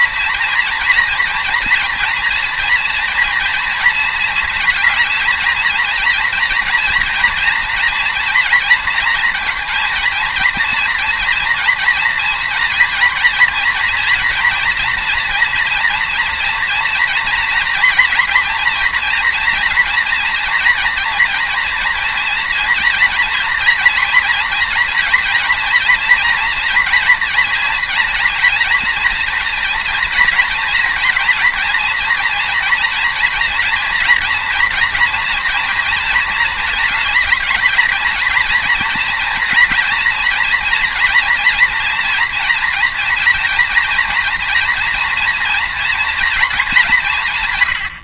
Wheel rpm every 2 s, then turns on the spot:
230, 230, 220, 230, 230, 230, 230, 230, 230, 240, 240, 230, 230, 230, 230, 230, 230, 230, 220, 230, 240, 230, 230, 200.
none